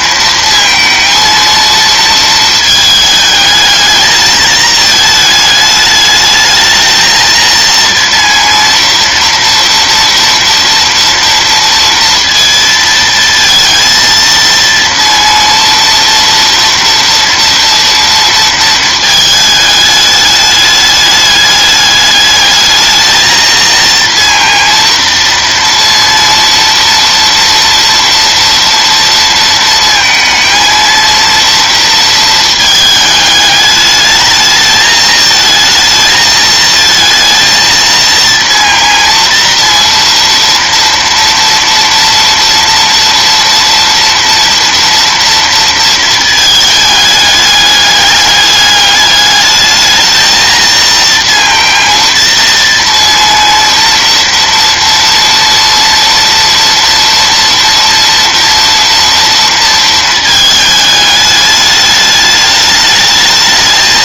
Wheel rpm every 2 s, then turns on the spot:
230, 220, 220, 220, 230, 230, 230, 230, 230, 220, 210, 220, 230, 230, 230, 230, 220, 220, 220, 230, 230, 240, 230, 210, 210, 230, 230, 230, 230, 230, 210, 210.
none